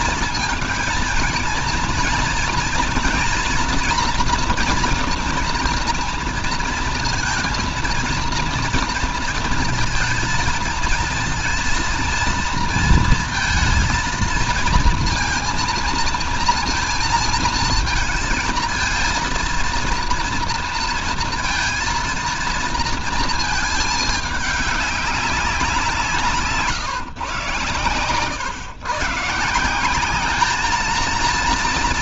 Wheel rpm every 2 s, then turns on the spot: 230, 240, 230, 230, 230, 230, 230, 230, 230, 230, 230, 230, 200, 130, 130, 220.
none